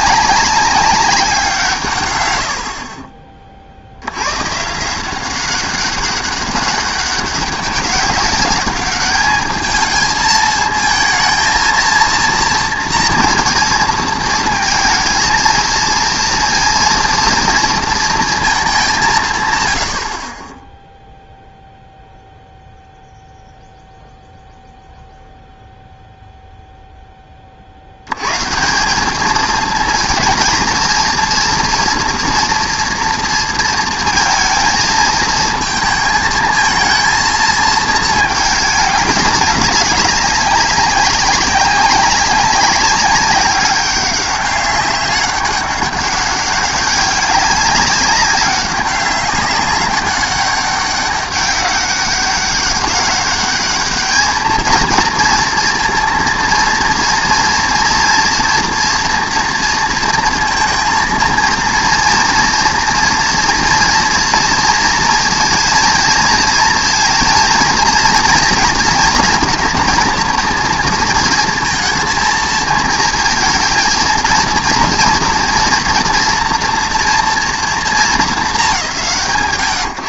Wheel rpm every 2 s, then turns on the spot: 190, 90, 130, 200, 210, 230, 230, 230, 230, 200, 20, 0, 0, 0, 150, 230, 230, 220, 220, 220, 190, 190, 200, 200, 190, 200, 200, 220, 230, 230, 230, 230, 230, 230, 230, 230, 220, 230, 230, 200.
none